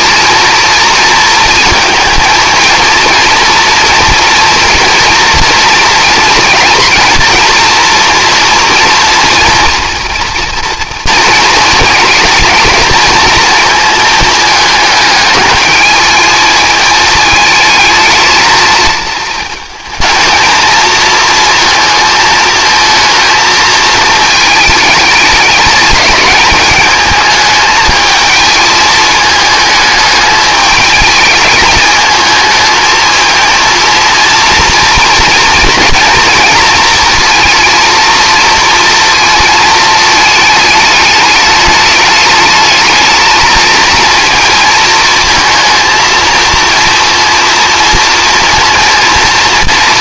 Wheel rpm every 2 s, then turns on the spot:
230, 230, 230, 230, 240, 230, 230, 220, 220, 220, 220, 220, 210, 210, 220, 210, 220, 230, 230, 230, 220, 220, 230, 230, 230.
none